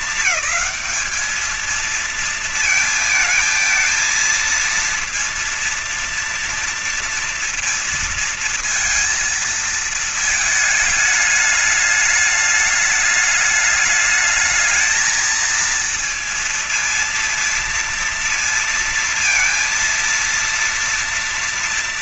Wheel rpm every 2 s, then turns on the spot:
220, 220, 230, 230, 230, 220, 210, 220, 230, 230, 230.
none